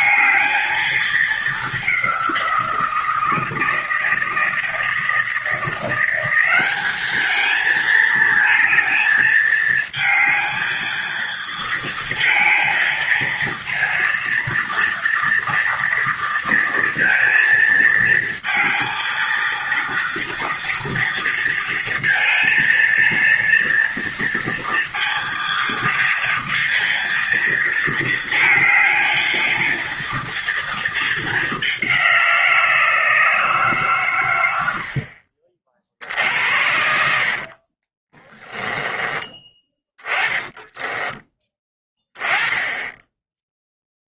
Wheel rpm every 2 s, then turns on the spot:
220, 170, 160, 200, 220, 220, 230, 230, 230, 230, 230, 230, 230, 230, 220, 230, 170, 90, 70, 10, 10, 10.
36-42